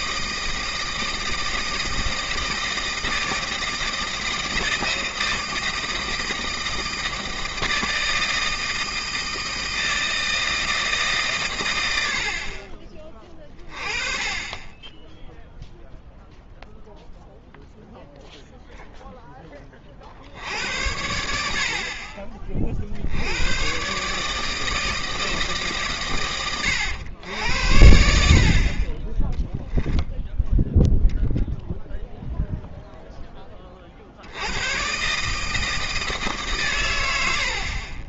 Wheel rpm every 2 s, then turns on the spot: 160, 160, 160, 160, 160, 160, 50, 20, 0, 0, 70, 40, 160, 110, 40, 10, 0, 90, 140.
none